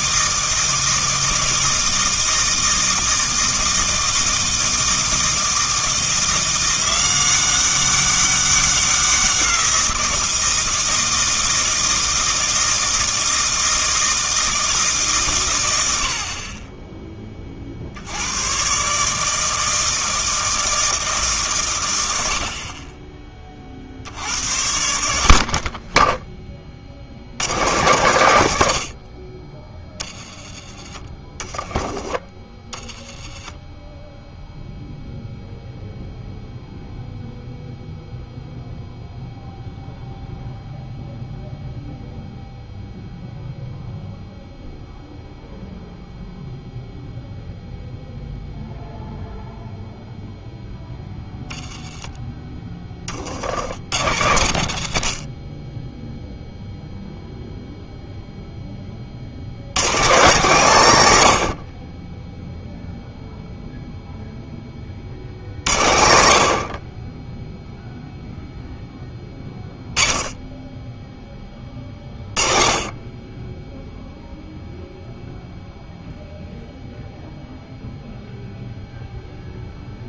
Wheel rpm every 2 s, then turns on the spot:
160, 160, 160, 180, 190, 160, 160, 160, 20, 120, 160, 40, 90, 40, 80, 20, 20, 0, 0, 0, 0, 0, 0, 0, 0, 0, 20, 90, 0, 20, 170, 0, 30, 60, 10, 10, 30, 0, 0, 0.
none